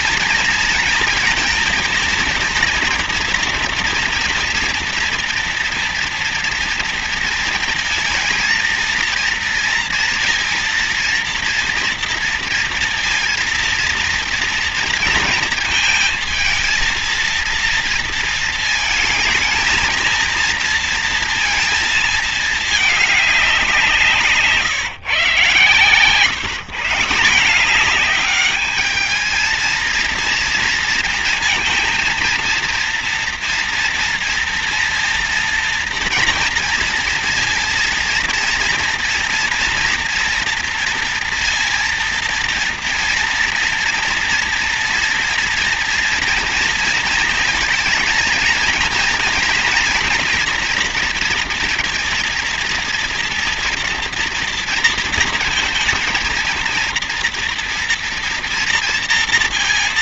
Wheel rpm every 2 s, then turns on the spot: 230, 230, 230, 230, 230, 230, 230, 230, 230, 220, 230, 210, 140, 160, 210, 230, 230, 230, 230, 230, 240, 230, 230, 230, 230, 230, 230, 230, 230, 230.
none